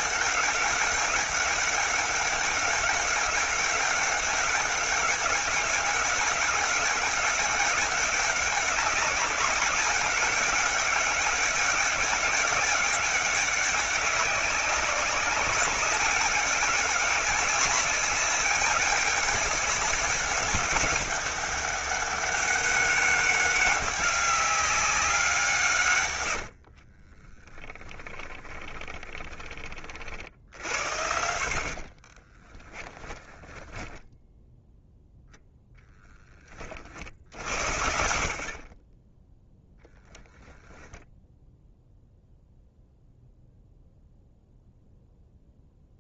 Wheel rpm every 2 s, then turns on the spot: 200, 200, 200, 200, 200, 190, 190, 190, 200, 200, 200, 200, 180, 30, 20, 60, 10, 0, 50, 10, 0, 0, 0.
26-30 32-34